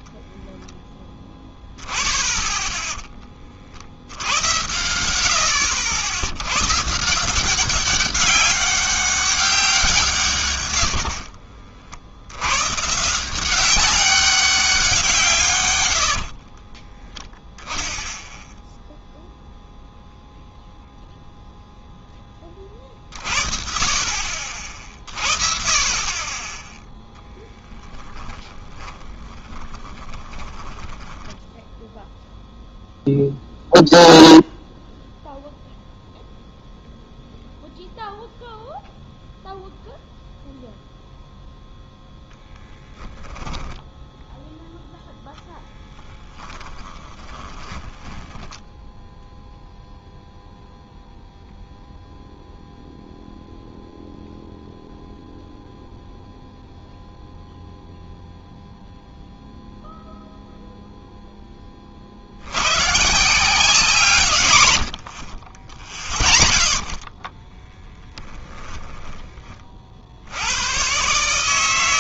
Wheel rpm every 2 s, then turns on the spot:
10, 10, 90, 120, 200, 120, 120, 200, 20, 0, 0, 30, 50, 10, 10, 20, 0, 0, 0, 0, 0, 0, 0, 20, 10, 0, 0, 0, 0, 0, 0, 110, 100, 30, 20, 100.
16-18 28-32 46-50 68-70